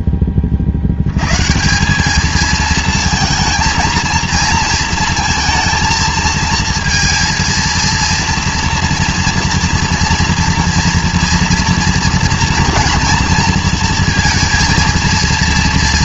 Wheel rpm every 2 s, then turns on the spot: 40, 220, 230, 230, 230, 230, 230, 230.
none